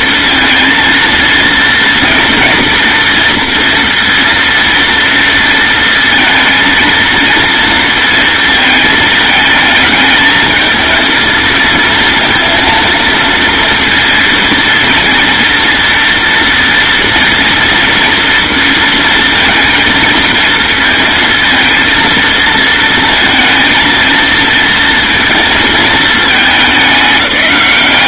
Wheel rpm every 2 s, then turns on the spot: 230, 230, 230, 230, 220, 220, 230, 230, 230, 230, 230, 230, 230, 200.
none